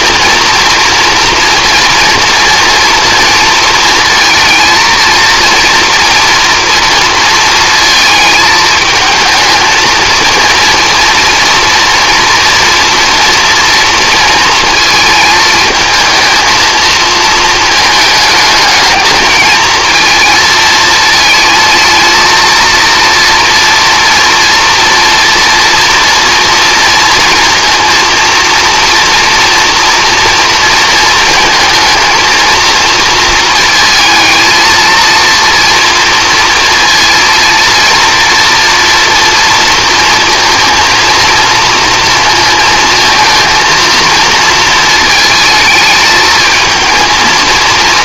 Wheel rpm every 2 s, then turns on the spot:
230, 230, 230, 230, 220, 230, 240, 220, 220, 220, 230, 230, 230, 230, 230, 230, 230, 230, 230, 230, 230, 230, 230, 220.
none